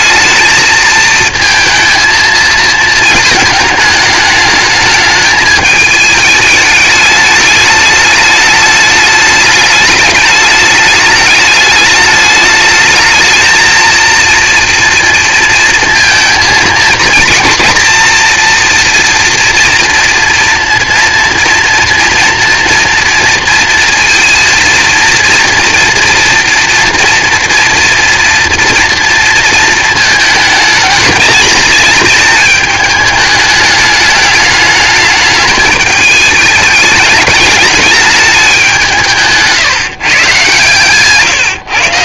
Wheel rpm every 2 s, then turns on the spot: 220, 220, 210, 210, 210, 210, 210, 230, 230, 230, 230, 240, 230, 230, 230, 220, 220, 210, 210, 200, 140.
none